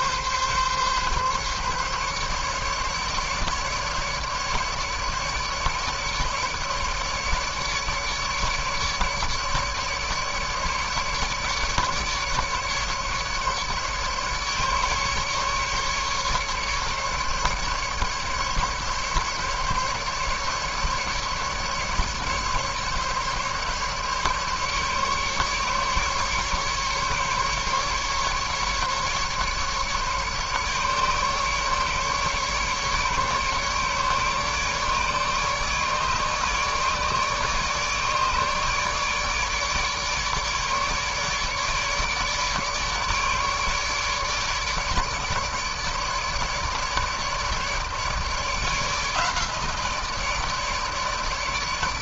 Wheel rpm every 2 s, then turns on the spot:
140, 140, 150, 150, 150, 150, 150, 150, 150, 150, 150, 150, 140, 150, 150, 140, 140, 150, 150, 150, 150, 150, 150, 150, 160, 160.
none